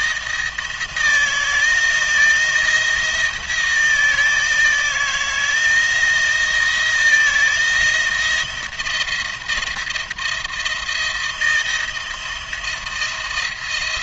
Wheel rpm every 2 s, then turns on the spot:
160, 160, 160, 170, 170, 170, 170.
none